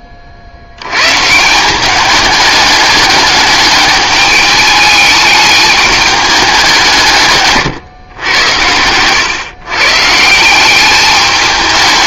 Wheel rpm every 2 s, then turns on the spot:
90, 210, 210, 180, 100, 190.
none